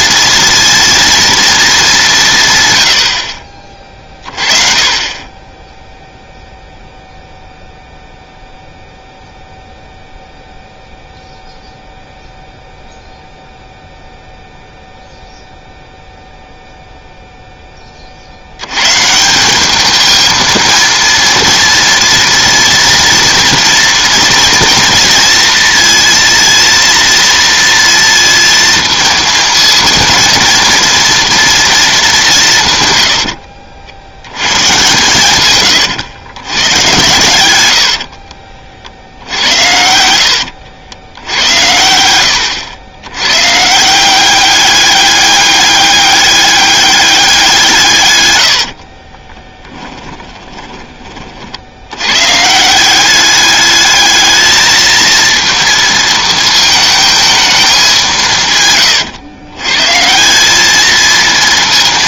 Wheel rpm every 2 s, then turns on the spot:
230, 110, 30, 0, 0, 0, 0, 0, 0, 110, 230, 230, 230, 230, 230, 230, 120, 110, 110, 50, 80, 100, 200, 200, 60, 20, 170, 220, 220, 130, 210.
48-50